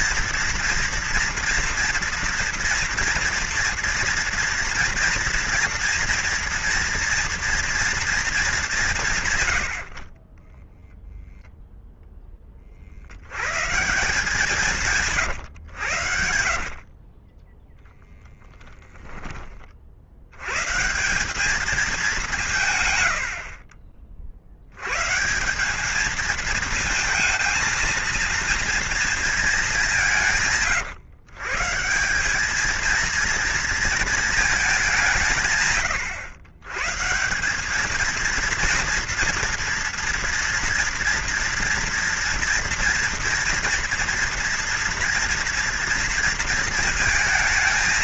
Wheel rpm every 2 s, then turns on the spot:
230, 230, 230, 230, 170, 0, 60, 170, 40, 10, 150, 110, 110, 220, 230, 150, 220, 190, 130, 230, 230, 230, 230, 230.
16-18